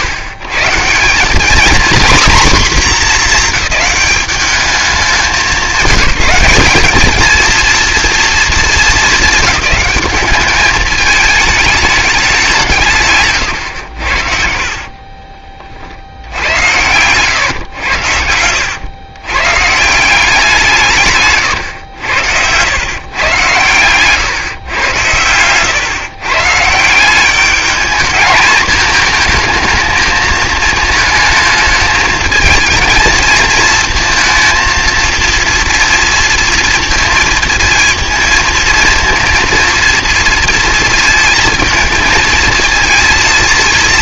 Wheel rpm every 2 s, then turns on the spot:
130, 230, 190, 190, 210, 210, 180, 50, 90, 90, 170, 100, 110, 150, 220, 220, 220, 230, 230, 220, 230, 230.
14-16